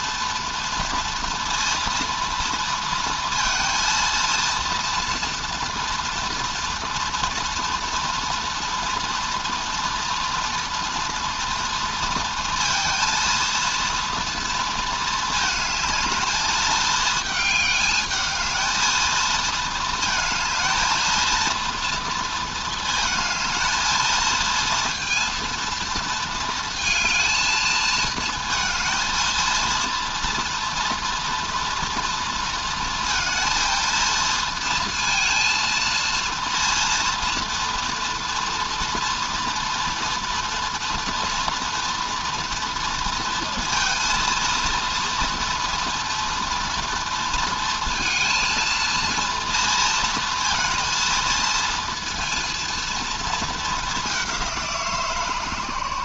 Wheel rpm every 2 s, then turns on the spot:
230, 230, 230, 230, 230, 230, 230, 230, 220, 220, 220, 220, 230, 220, 230, 240, 230, 230, 230, 240, 230, 230, 230, 240, 230, 230, 230, 170.
none